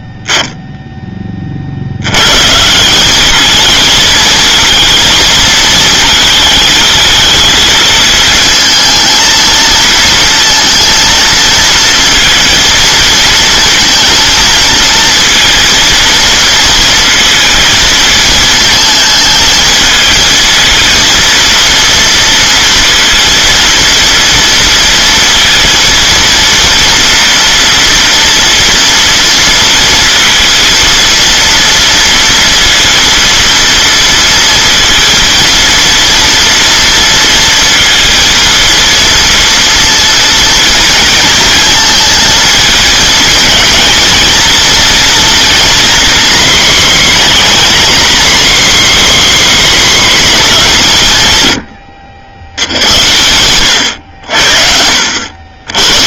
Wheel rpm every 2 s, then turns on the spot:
0, 160, 230, 220, 220, 230, 230, 230, 230, 220, 220, 230, 230, 230, 230, 230, 230, 230, 230, 230, 230, 220, 230, 260, 280, 200, 90, 70.
none